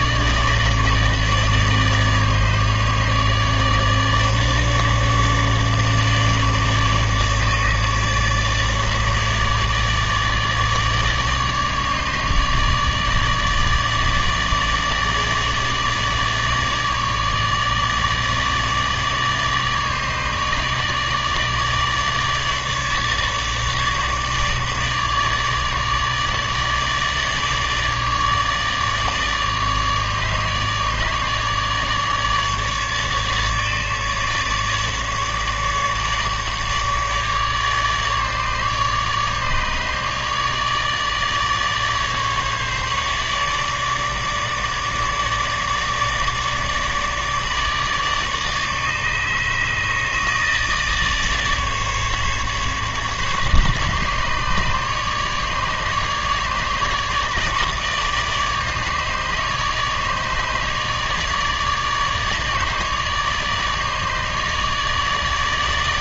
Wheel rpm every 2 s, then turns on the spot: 150, 150, 150, 150, 150, 150, 150, 150, 150, 150, 150, 150, 150, 150, 150, 150, 150, 150, 150, 150, 150, 150, 150, 150, 150, 160, 150, 150, 150, 150, 150, 150, 150.
none